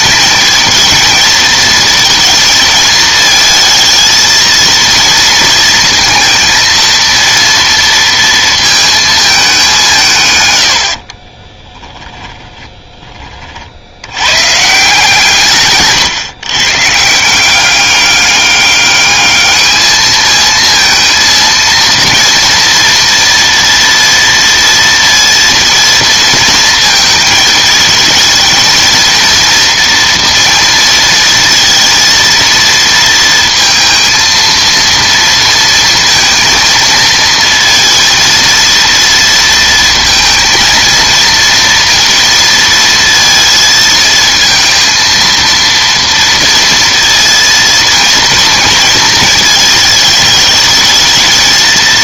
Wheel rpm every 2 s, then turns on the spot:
220, 220, 230, 230, 220, 50, 10, 160, 150, 210, 230, 230, 230, 220, 230, 230, 230, 230, 230, 230, 230, 230, 230, 230, 230, 220.
10-12